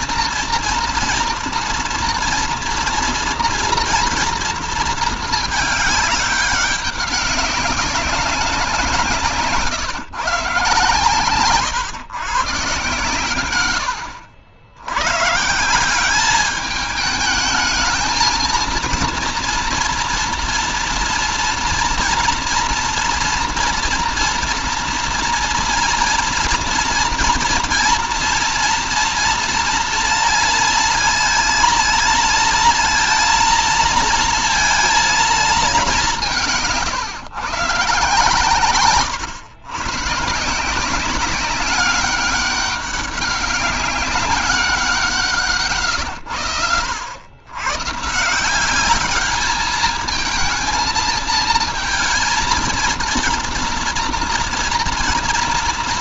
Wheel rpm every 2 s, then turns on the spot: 240, 230, 230, 200, 180, 140, 130, 90, 210, 230, 240, 240, 230, 240, 240, 230, 230, 230, 160, 130, 170, 200, 180, 90, 200, 220, 230, 230.
none